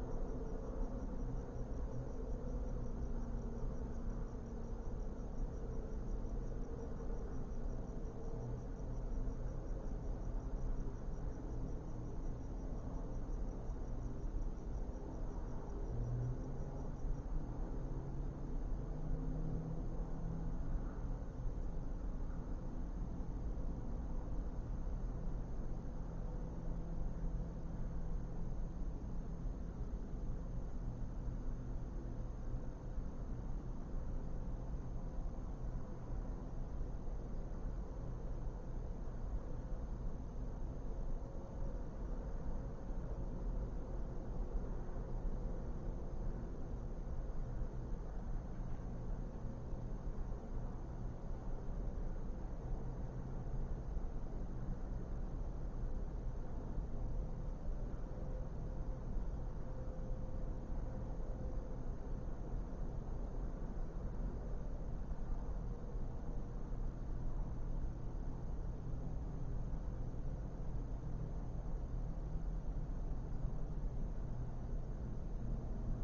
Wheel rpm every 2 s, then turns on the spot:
0, 0, 0, 0, 0, 0, 0, 0, 0, 0, 0, 0, 0, 0, 0, 0, 0, 0, 0, 0, 0, 0, 0, 0, 0, 0, 0, 0, 0, 0, 0, 0, 0, 0, 0, 0, 0, 0.
none